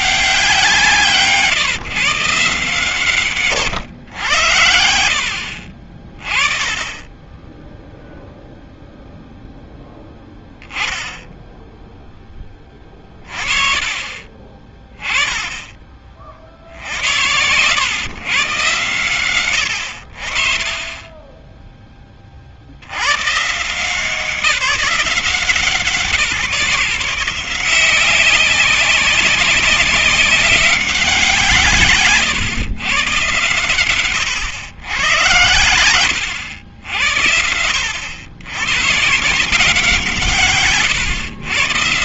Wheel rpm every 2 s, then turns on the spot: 150, 110, 40, 10, 0, 10, 20, 20, 100, 100, 20, 150, 180, 170, 190, 160, 110, 100, 80, 150, 100.
12-14